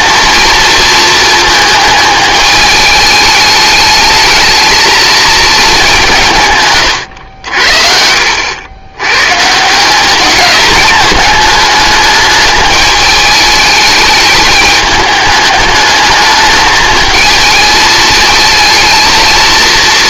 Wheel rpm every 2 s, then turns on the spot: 230, 210, 220, 130, 100, 210, 210, 210, 220, 220.
none